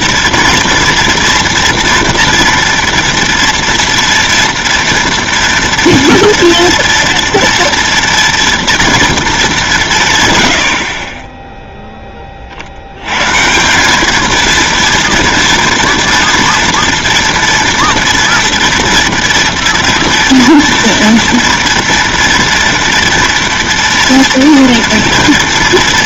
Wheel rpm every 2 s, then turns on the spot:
240, 230, 230, 230, 230, 60, 80, 230, 230, 230, 230, 230, 230.
none